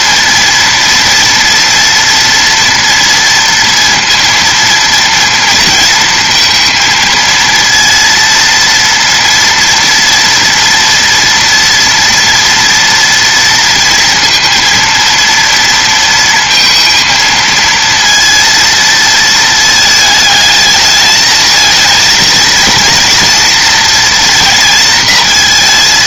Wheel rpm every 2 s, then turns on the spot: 230, 230, 230, 230, 230, 230, 230, 230, 230, 230, 220, 230, 230.
none